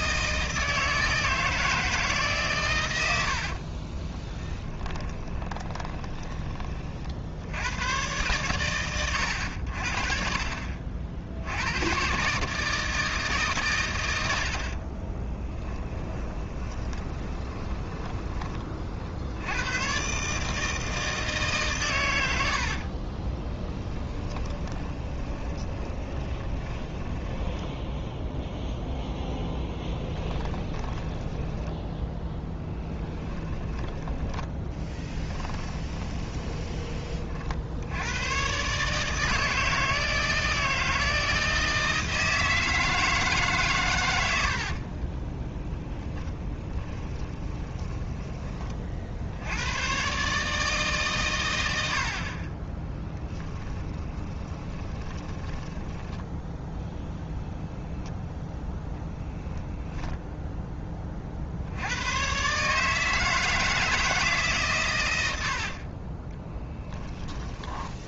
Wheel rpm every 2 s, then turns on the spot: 160, 100, 20, 40, 110, 60, 160, 40, 30, 40, 160, 40, 20, 20, 0, 10, 10, 10, 30, 140, 160, 160, 40, 20, 40, 150, 20, 20, 0, 0, 20, 150, 120, 10.
4-6 14-18 22-28 30-36 44-48 52-56 66-68